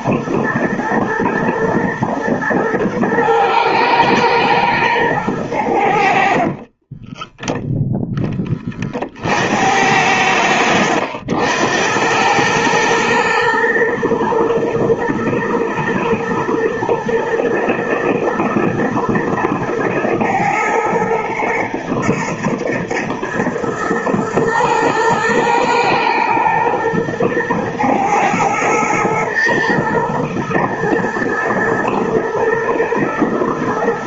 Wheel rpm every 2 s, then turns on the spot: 120, 110, 110, 30, 30, 80, 110, 120, 110, 120, 120, 120, 120, 120, 110, 120, 120.
6-8